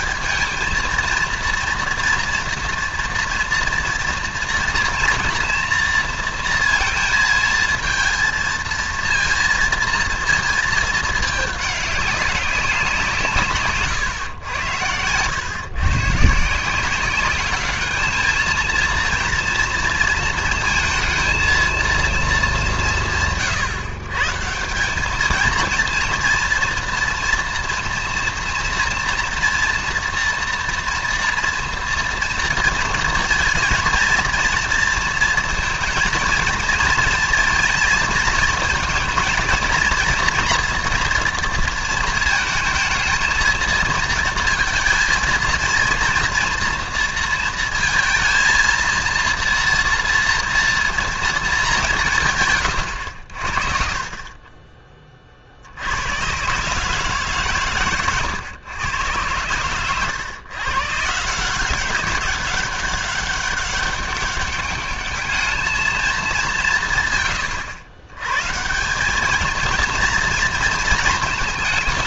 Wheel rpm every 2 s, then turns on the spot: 220, 230, 230, 230, 230, 230, 190, 100, 160, 220, 220, 190, 160, 230, 230, 230, 230, 230, 230, 220, 240, 220, 230, 230, 230, 230, 120, 30, 140, 120, 130, 200, 200, 180, 150, 230.
none